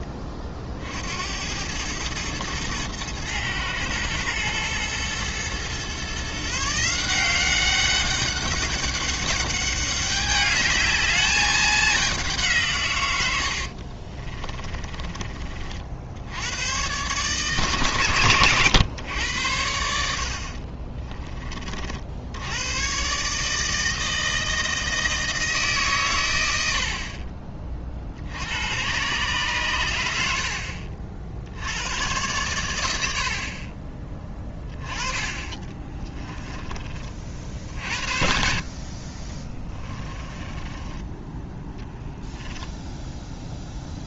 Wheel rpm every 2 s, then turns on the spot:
50, 120, 120, 160, 200, 210, 140, 20, 120, 120, 40, 120, 160, 60, 110, 60, 90, 20, 20, 50, 20, 0.
14-16 20-22 40-42